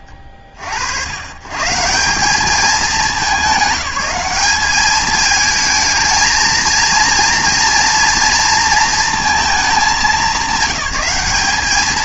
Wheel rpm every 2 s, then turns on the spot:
50, 190, 200, 230, 230, 200.
none